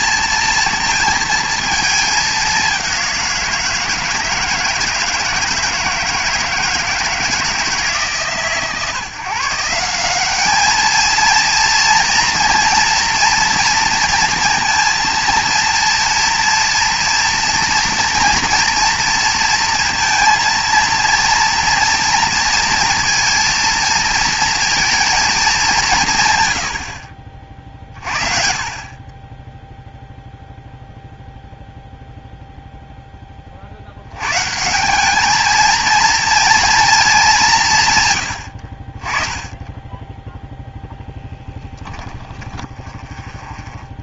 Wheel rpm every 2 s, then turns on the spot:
230, 200, 160, 160, 140, 210, 230, 230, 230, 240, 230, 230, 230, 120, 40, 0, 0, 160, 230, 60, 0, 10.
42-44